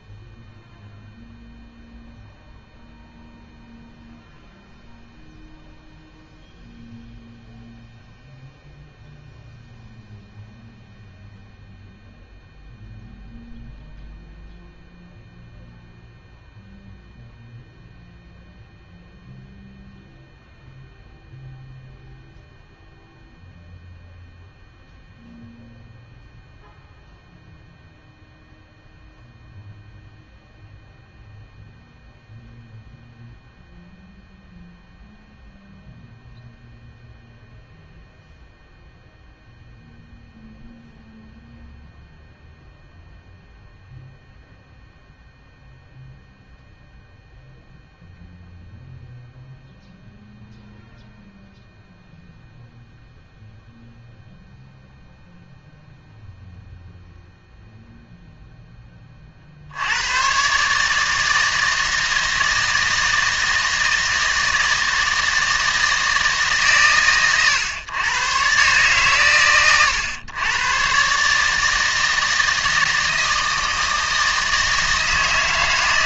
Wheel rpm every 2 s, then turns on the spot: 0, 0, 0, 0, 0, 0, 0, 0, 0, 0, 0, 0, 0, 0, 0, 0, 0, 0, 0, 0, 0, 0, 0, 0, 0, 0, 0, 0, 0, 10, 150, 160, 160, 120, 130, 120, 160, 160.
none